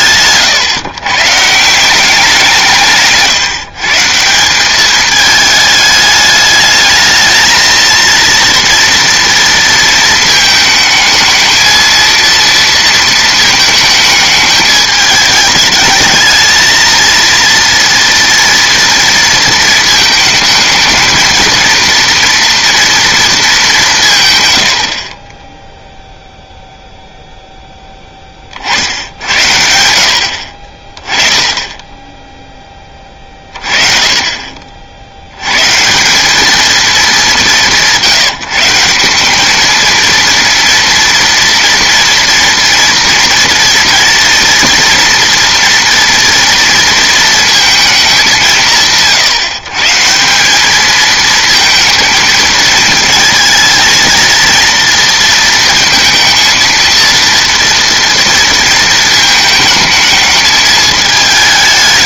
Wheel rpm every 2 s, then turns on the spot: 130, 160, 200, 210, 230, 220, 230, 210, 220, 230, 220, 230, 100, 0, 60, 40, 20, 50, 220, 170, 230, 230, 230, 230, 160, 200, 230, 230, 230, 230, 220.
none